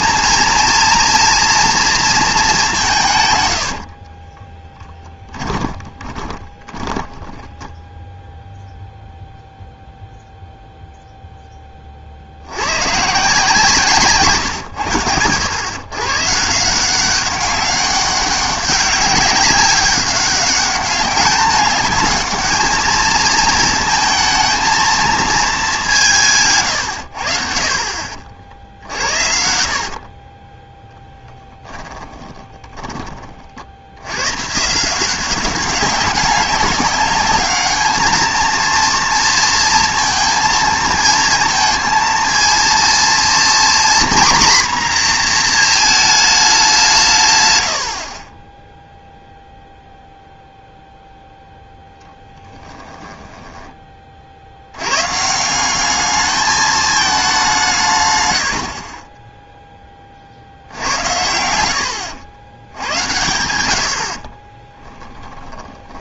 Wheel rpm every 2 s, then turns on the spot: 230, 190, 10, 20, 0, 0, 120, 110, 170, 200, 200, 220, 220, 110, 60, 10, 30, 160, 200, 230, 230, 230, 250, 190, 10, 0, 10, 100, 220, 50, 80, 90, 10.
4-8 52-54 64-66